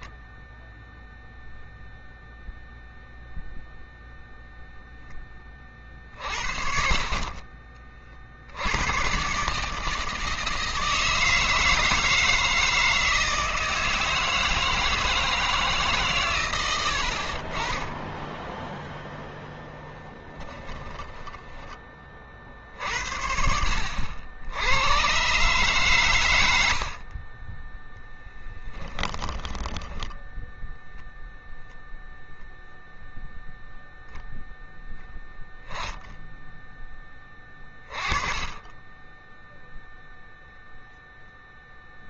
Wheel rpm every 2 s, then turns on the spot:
0, 0, 0, 50, 80, 160, 160, 160, 90, 0, 30, 60, 100, 80, 10, 0, 0, 0, 10, 10, 0.
20-22 28-30